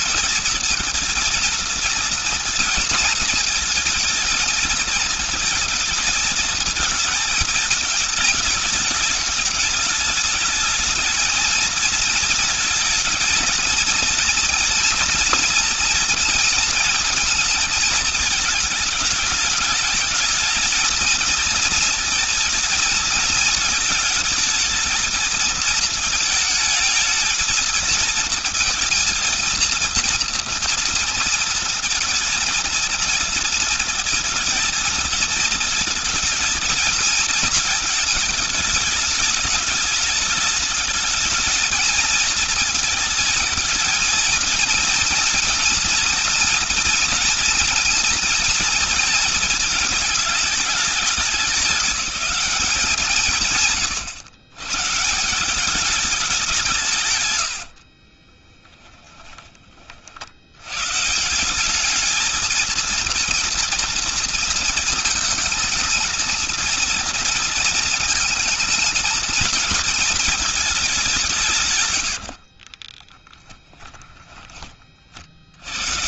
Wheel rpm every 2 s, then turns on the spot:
230, 230, 230, 220, 210, 220, 230, 230, 230, 210, 220, 220, 220, 220, 230, 230, 230, 230, 230, 210, 210, 220, 230, 230, 220, 210, 190, 120, 190, 20, 100, 220, 220, 230, 220, 210, 40, 30.
58-60 72-74